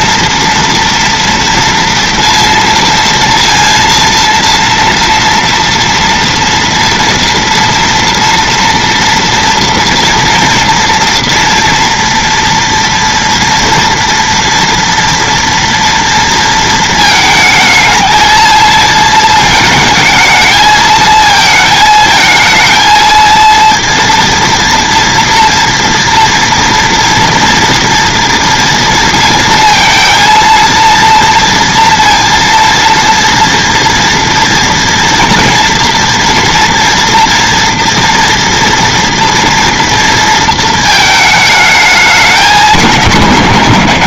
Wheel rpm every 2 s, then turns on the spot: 230, 230, 230, 230, 230, 230, 230, 230, 220, 220, 220, 230, 230, 230, 230, 230, 230, 230, 230, 240, 230, 200.
none